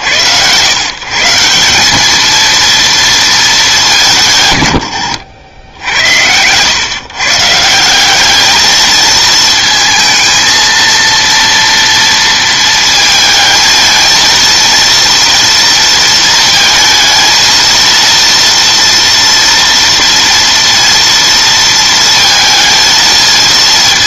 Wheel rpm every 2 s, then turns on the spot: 120, 230, 110, 120, 220, 230, 230, 230, 230, 230, 230, 220.
none